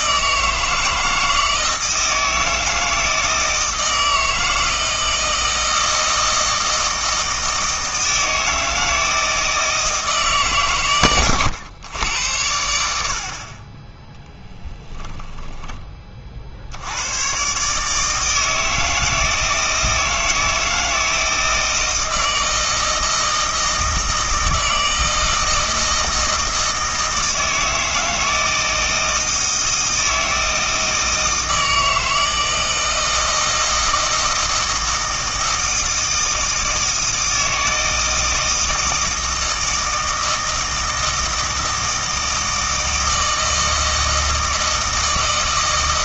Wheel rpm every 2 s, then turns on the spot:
160, 160, 160, 160, 160, 130, 80, 10, 70, 160, 160, 160, 160, 160, 160, 160, 160, 160, 160, 160, 160, 160, 160.
14-16